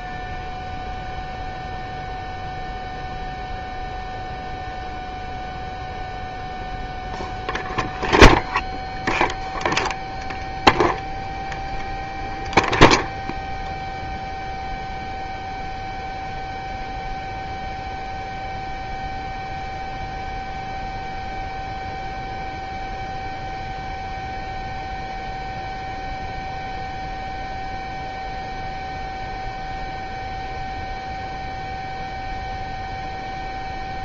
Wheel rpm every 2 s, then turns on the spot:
0, 0, 0, 0, 0, 0, 0, 0, 0, 0, 0, 0, 0, 0, 0, 0, 0.
none